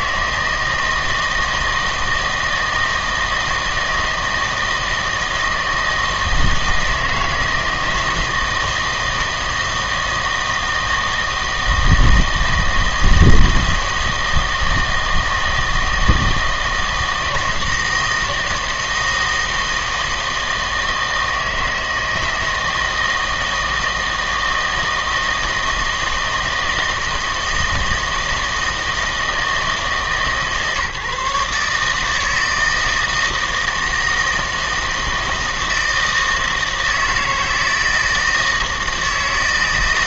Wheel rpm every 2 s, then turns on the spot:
160, 160, 160, 160, 160, 160, 160, 160, 160, 160, 160, 160, 160, 160, 160, 150, 160, 160, 160, 160.
none